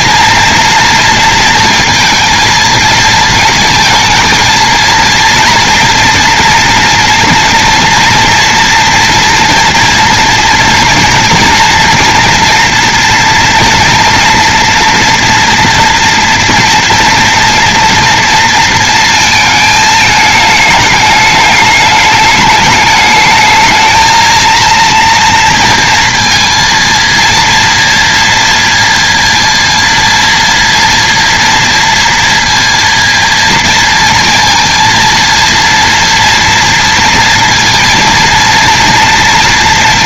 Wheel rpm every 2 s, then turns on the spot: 230, 220, 230, 230, 240, 230, 230, 240, 240, 230, 210, 210, 230, 230, 230, 230, 230, 230, 230, 230.
none